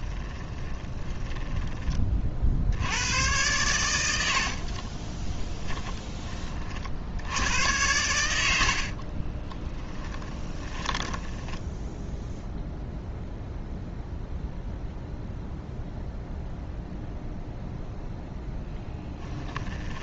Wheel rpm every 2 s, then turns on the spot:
20, 80, 40, 50, 50, 10, 0, 0, 0, 10.
0-2 4-6 8-12 18-20